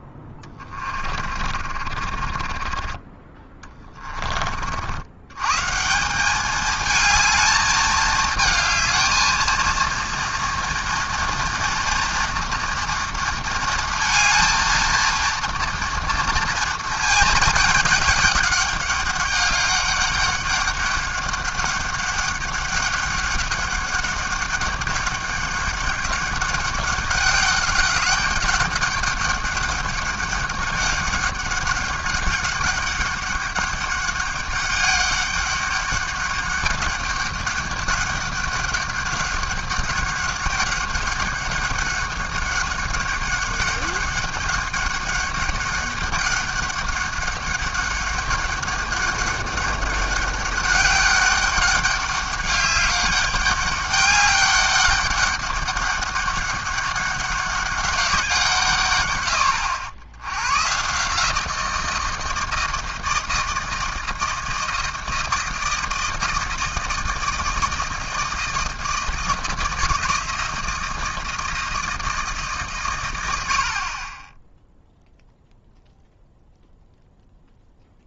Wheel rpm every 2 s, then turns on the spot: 30, 30, 50, 220, 220, 230, 230, 230, 230, 200, 200, 200, 200, 200, 200, 200, 200, 200, 200, 200, 200, 200, 200, 200, 200, 200, 200, 200, 200, 150, 130, 160, 160, 160, 160, 160, 140, 0, 0.
0-4